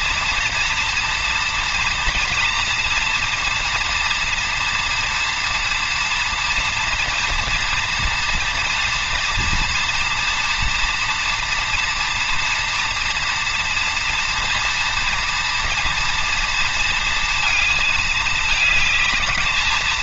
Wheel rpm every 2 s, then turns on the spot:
240, 230, 230, 230, 230, 230, 230, 230, 230, 220.
none